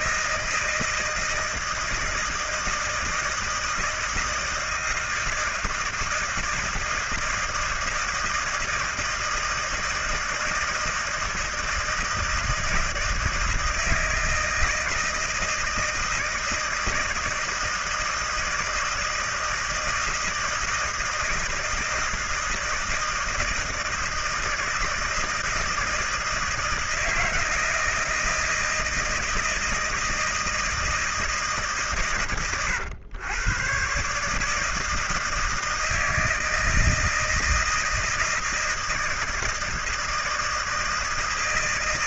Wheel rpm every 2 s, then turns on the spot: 160, 160, 160, 160, 160, 160, 160, 160, 160, 160, 160, 160, 160, 160, 160, 160, 100, 160, 160, 160, 160.
none